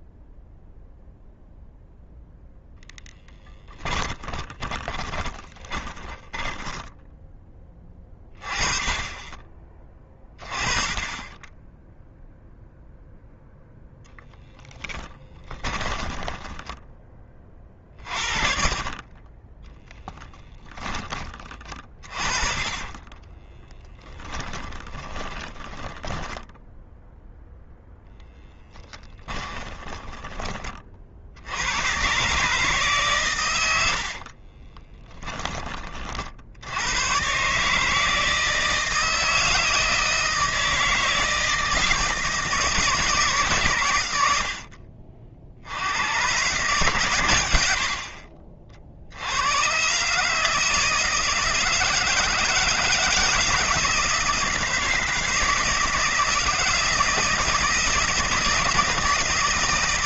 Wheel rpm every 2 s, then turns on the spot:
0, 0, 20, 10, 20, 30, 0, 10, 20, 40, 20, 20, 10, 0, 20, 50, 140, 20, 100, 160, 160, 150, 50, 120, 70, 160, 160, 160, 160, 160.
4-6 14-16 22-26 28-30 34-36